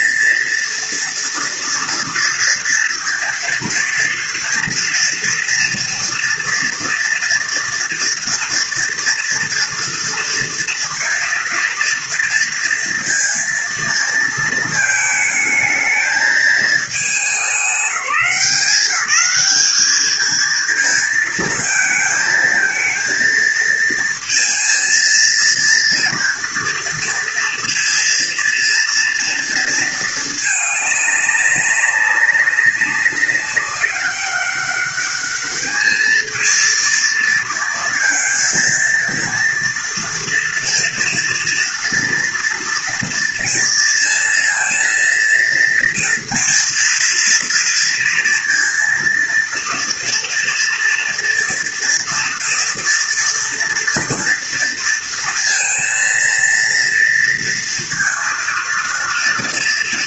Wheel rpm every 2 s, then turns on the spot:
230, 230, 230, 230, 230, 230, 230, 220, 210, 180, 220, 230, 230, 230, 230, 210, 200, 200, 220, 230, 230, 230, 230, 230, 230, 240, 230, 230, 230, 230.
none